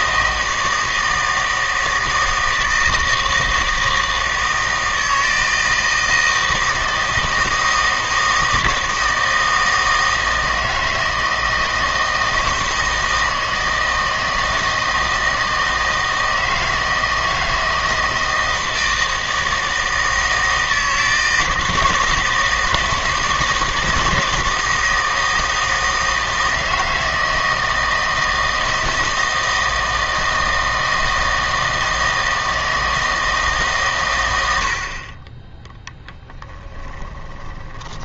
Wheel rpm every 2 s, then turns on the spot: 160, 160, 160, 160, 160, 160, 160, 160, 160, 160, 160, 160, 160, 160, 160, 160, 160, 60, 20.
36-38